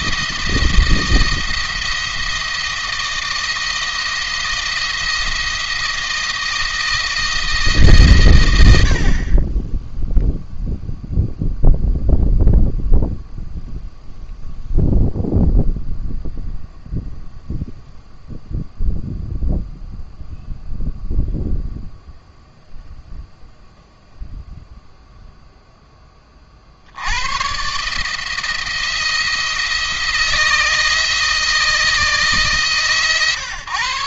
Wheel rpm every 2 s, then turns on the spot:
170, 160, 170, 170, 90, 0, 0, 0, 0, 0, 0, 0, 0, 50, 160, 160, 150.
none